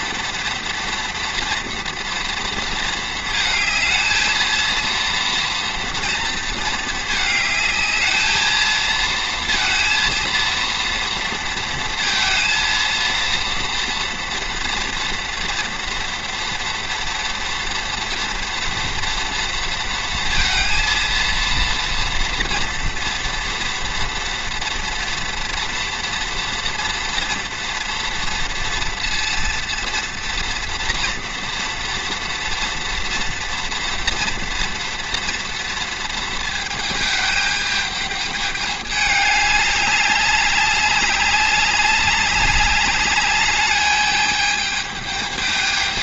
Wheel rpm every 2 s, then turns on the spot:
230, 230, 220, 230, 220, 230, 230, 230, 230, 230, 230, 230, 230, 240, 240, 230, 230, 230, 230, 210, 200, 200, 210.
none